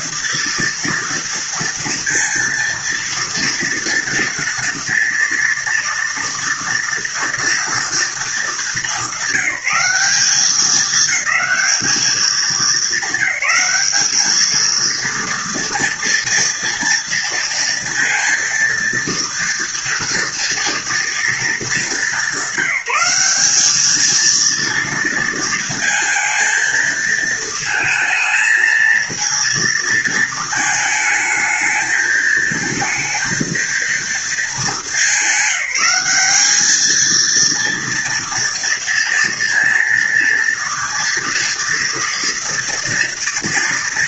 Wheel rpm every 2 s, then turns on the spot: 240, 230, 230, 230, 220, 200, 210, 210, 230, 230, 230, 200, 230, 230, 220, 220, 220, 220, 210, 230, 230, 230.
none